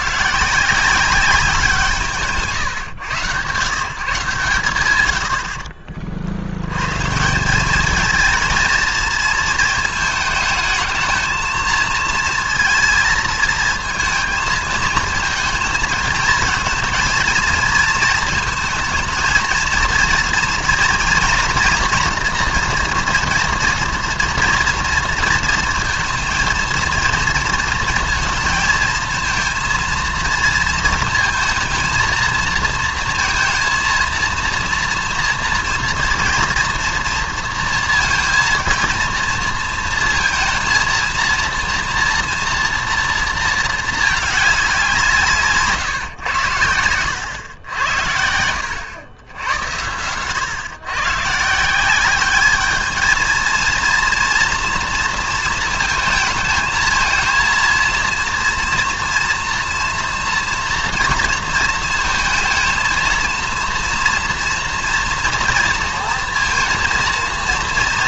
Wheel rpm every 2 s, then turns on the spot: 180, 140, 130, 110, 230, 220, 230, 220, 230, 220, 220, 240, 230, 230, 230, 230, 230, 230, 230, 230, 230, 240, 190, 100, 90, 120, 210, 230, 220, 230, 240, 230, 230, 230.
none